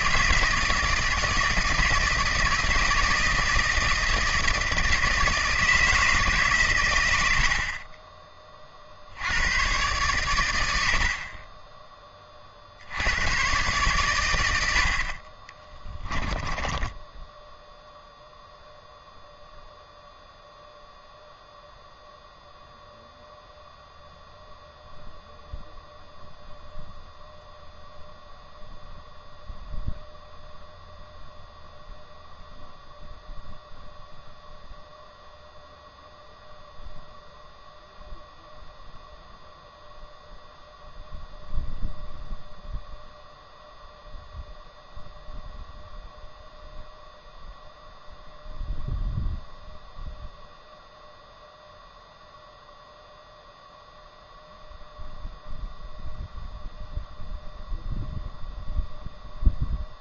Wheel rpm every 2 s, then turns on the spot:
160, 160, 160, 140, 40, 90, 60, 70, 10, 0, 0, 0, 0, 0, 0, 0, 0, 0, 0, 0, 0, 0, 0, 0, 0, 0, 0, 0, 0, 0.
16-18